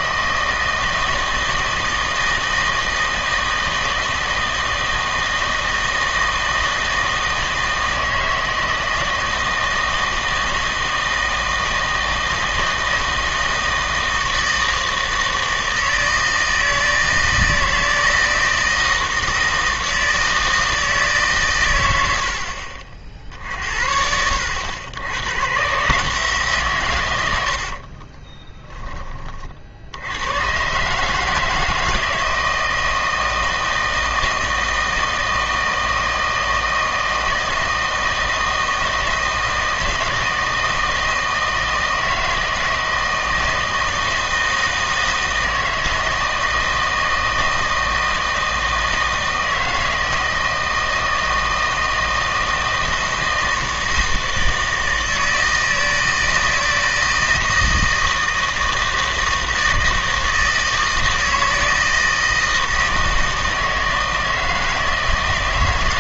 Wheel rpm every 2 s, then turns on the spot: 160, 160, 160, 160, 160, 160, 160, 160, 160, 160, 160, 60, 90, 140, 10, 130, 160, 160, 160, 160, 160, 160, 160, 160, 160, 160, 160, 160, 160, 160, 160, 160, 160.
none